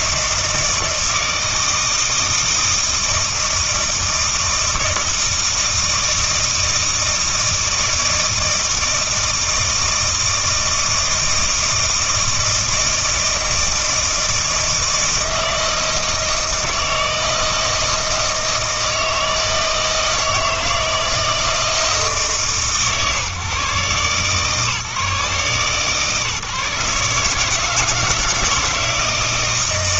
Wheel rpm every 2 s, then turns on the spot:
160, 160, 160, 160, 160, 160, 160, 160, 160, 160, 160, 140, 150, 150, 160.
none